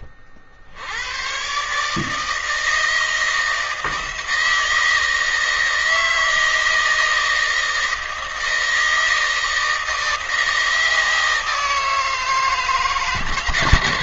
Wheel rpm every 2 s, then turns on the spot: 50, 160, 160, 160, 160, 160, 150.
none